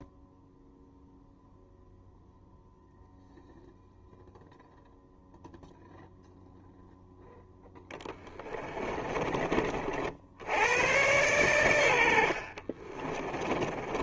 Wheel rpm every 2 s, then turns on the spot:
0, 0, 0, 0, 10, 60, 70.
8-10